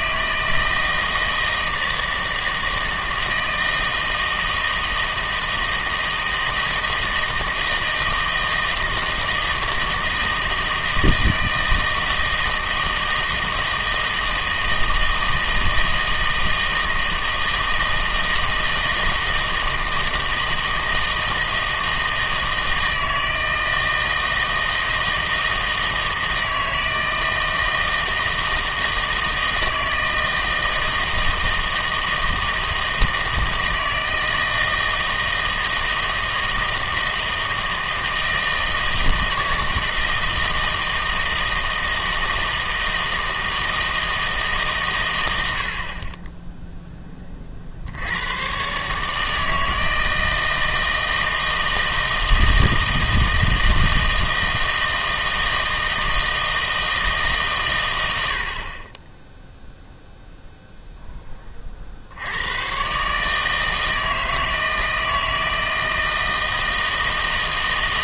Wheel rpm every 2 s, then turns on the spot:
160, 160, 160, 160, 160, 160, 160, 160, 160, 160, 160, 160, 160, 160, 160, 160, 160, 160, 160, 160, 160, 160, 140, 10, 130, 160, 160, 160, 160, 40, 0, 100, 160, 160.
none